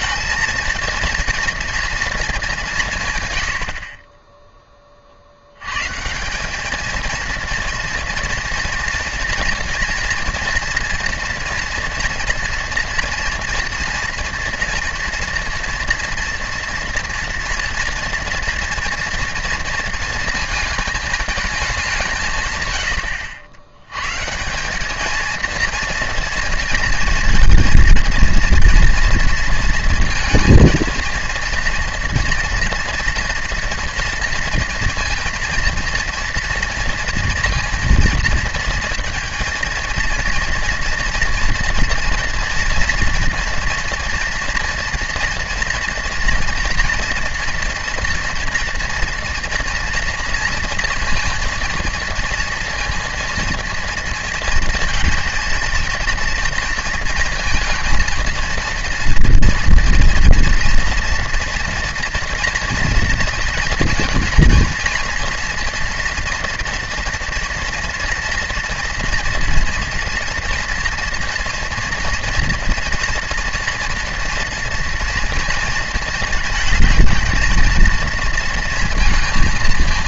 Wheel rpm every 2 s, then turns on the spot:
230, 190, 20, 210, 230, 230, 230, 230, 230, 230, 220, 120, 190, 230, 230, 230, 230, 230, 230, 230, 230, 230, 230, 230, 230, 230, 230, 230, 230, 230, 230, 230, 230, 230, 230, 230, 230, 240, 220, 230.
none